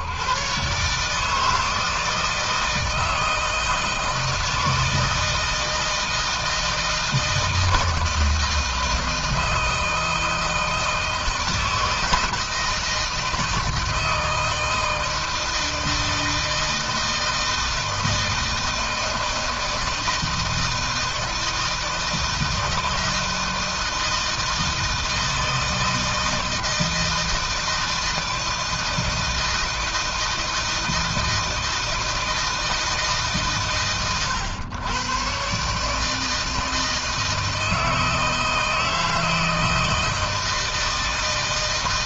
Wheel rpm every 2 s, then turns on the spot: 140, 160, 160, 160, 160, 160, 160, 160, 160, 160, 160, 160, 160, 160, 160, 160, 160, 120, 160, 160, 160.
none